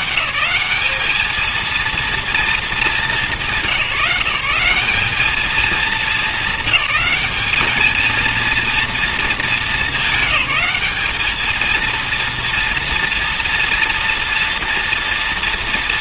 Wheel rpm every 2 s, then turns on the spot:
200, 220, 180, 220, 230, 200, 230, 230.
none